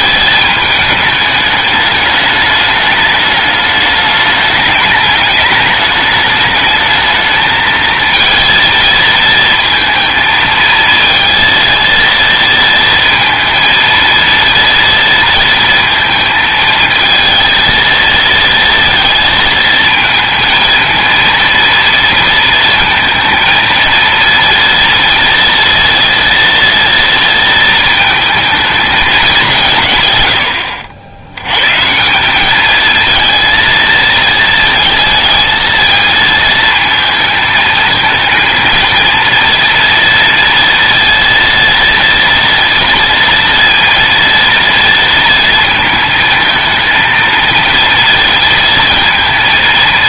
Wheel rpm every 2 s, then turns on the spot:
220, 210, 210, 220, 230, 220, 230, 230, 220, 230, 220, 220, 230, 230, 220, 80, 210, 220, 220, 230, 230, 230, 230, 220, 230.
none